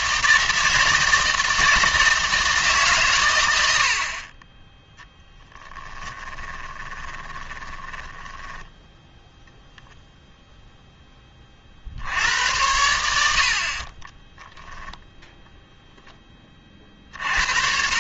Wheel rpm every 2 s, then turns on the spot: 160, 150, 10, 10, 10, 10, 90, 0, 40.
6-8